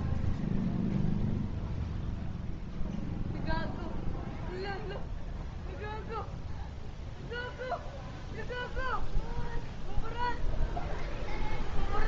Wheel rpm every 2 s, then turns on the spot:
0, 0, 0, 0, 0, 0.
none